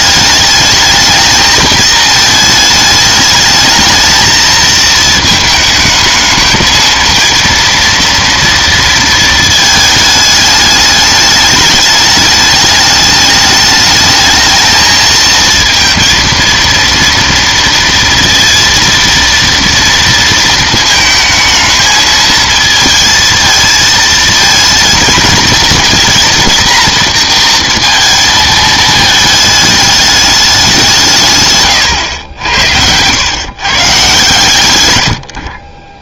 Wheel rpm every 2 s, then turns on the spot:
220, 220, 220, 230, 230, 210, 210, 220, 230, 230, 220, 220, 230, 230, 220, 190, 90, 100.
34-36